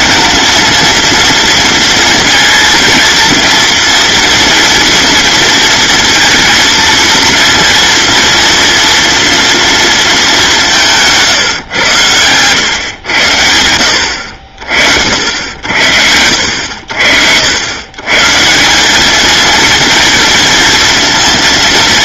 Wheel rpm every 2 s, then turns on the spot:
230, 230, 230, 230, 240, 170, 110, 60, 60, 190, 230.
none